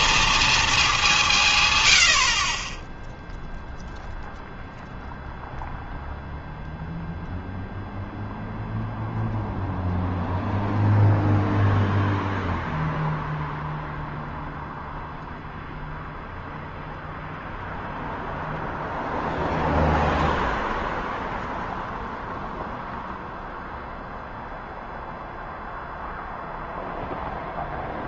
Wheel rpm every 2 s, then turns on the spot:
230, 50, 0, 0, 0, 0, 0, 0, 0, 0, 0, 0, 0, 0.
none